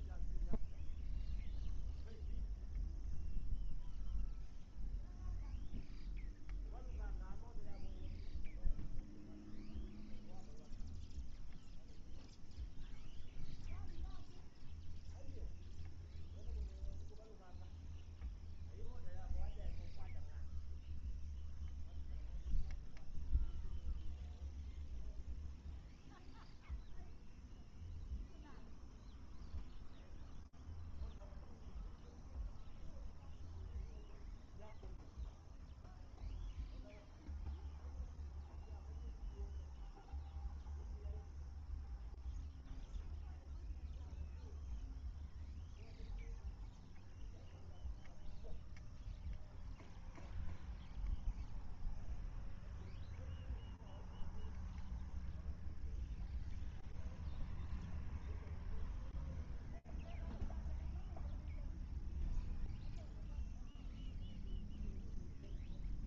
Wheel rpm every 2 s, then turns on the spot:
0, 0, 0, 0, 0, 0, 0, 0, 0, 0, 0, 0, 0, 0, 0, 0, 0, 0, 0, 0, 0, 0, 0, 0, 0, 0, 0, 0, 0, 0, 0, 0, 0.
none